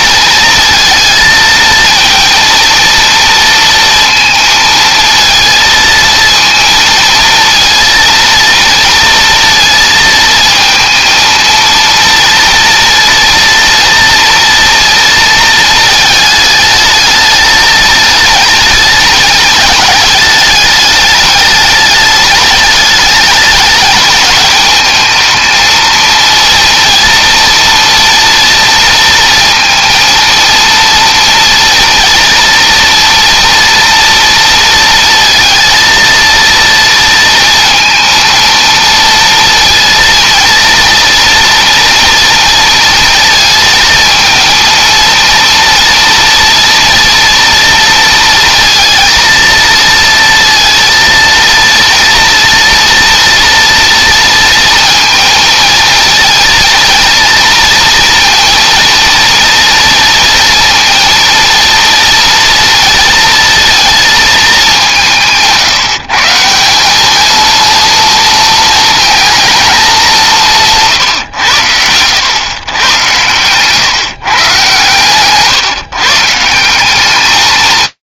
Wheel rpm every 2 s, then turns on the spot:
230, 230, 220, 230, 230, 230, 230, 230, 220, 210, 210, 210, 220, 230, 230, 230, 240, 230, 230, 230, 230, 230, 230, 240, 230, 230, 230, 230, 230, 230, 230, 230, 180, 200, 220, 140, 120, 130, 190.
none